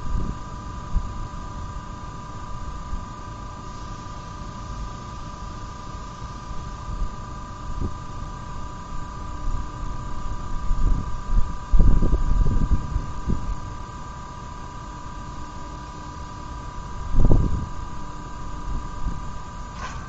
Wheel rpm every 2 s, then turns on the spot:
0, 0, 0, 0, 0, 0, 0, 0, 0, 0.
none